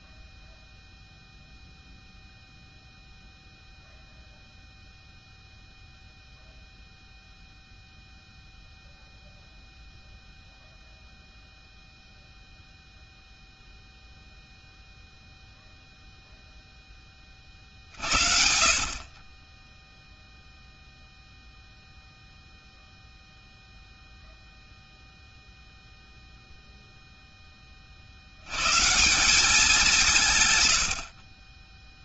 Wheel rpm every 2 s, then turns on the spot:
0, 0, 0, 0, 0, 0, 0, 0, 0, 50, 0, 0, 0, 0, 100, 120.
none